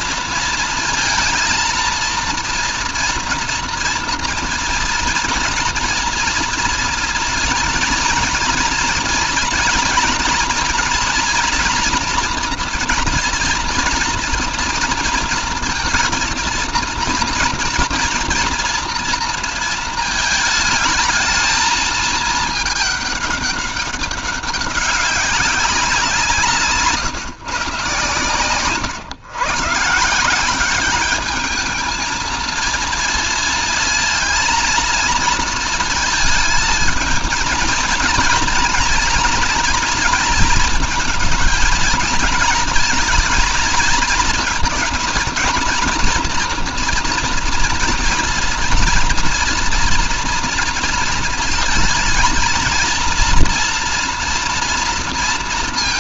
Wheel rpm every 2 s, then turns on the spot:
230, 230, 230, 240, 230, 240, 230, 230, 230, 230, 220, 210, 200, 150, 130, 210, 230, 230, 220, 230, 230, 230, 230, 230, 240, 230, 230, 230.
none